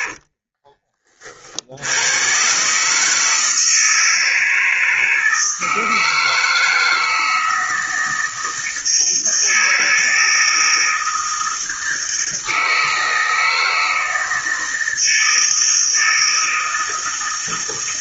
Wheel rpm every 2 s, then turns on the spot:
30, 140, 160, 160, 160, 160, 160, 160, 160.
none